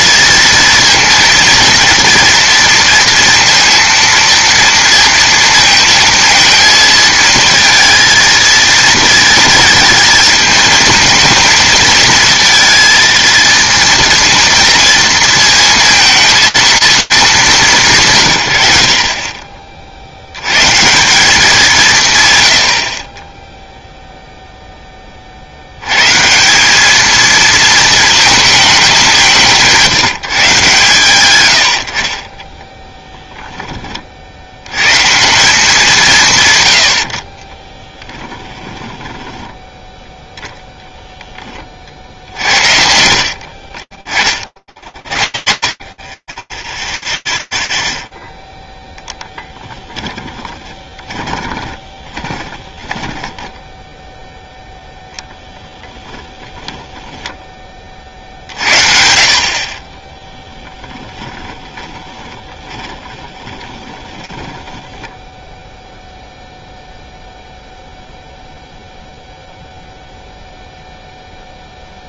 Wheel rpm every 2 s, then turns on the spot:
220, 230, 230, 220, 230, 220, 230, 230, 230, 90, 160, 60, 0, 200, 210, 130, 10, 90, 120, 10, 20, 60, 50, 20, 0, 20, 20, 0, 0, 40, 20, 20, 10, 0, 0, 0.
32-34 38-42 50-54 60-64